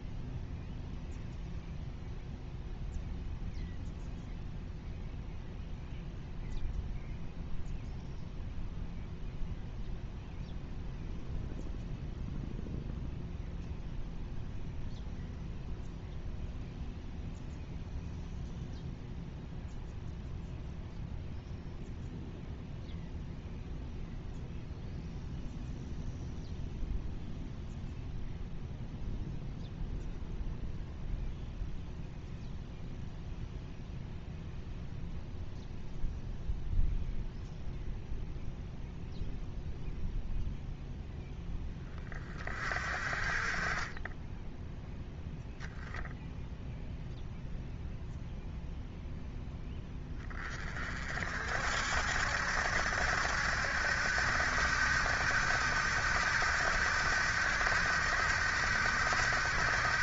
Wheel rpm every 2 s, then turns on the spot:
0, 0, 0, 0, 0, 0, 0, 0, 0, 0, 0, 0, 0, 0, 0, 0, 0, 0, 0, 0, 0, 30, 10, 0, 0, 30, 70, 80, 80, 80.
none